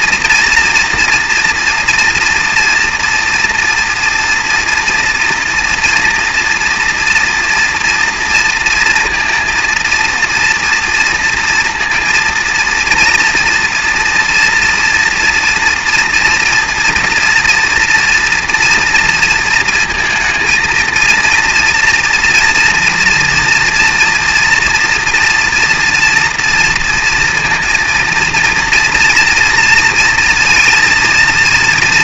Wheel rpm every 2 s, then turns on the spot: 230, 230, 230, 230, 230, 230, 230, 230, 230, 230, 220, 240, 240, 230, 230, 230.
none